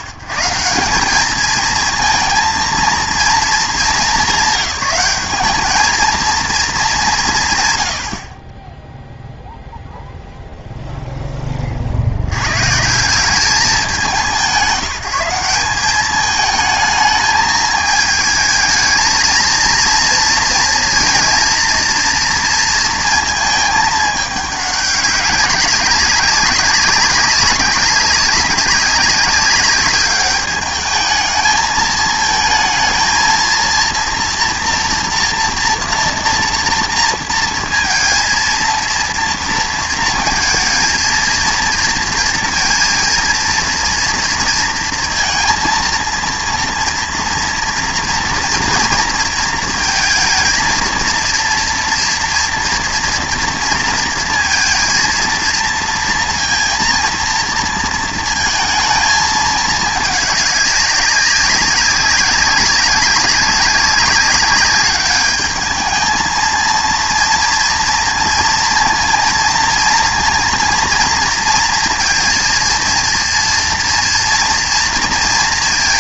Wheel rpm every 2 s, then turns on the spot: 140, 230, 200, 220, 20, 0, 130, 170, 220, 220, 230, 230, 200, 200, 200, 210, 230, 240, 230, 230, 220, 230, 230, 230, 230, 230, 240, 230, 230, 230, 200, 200, 200, 230, 230, 240, 230, 240.
none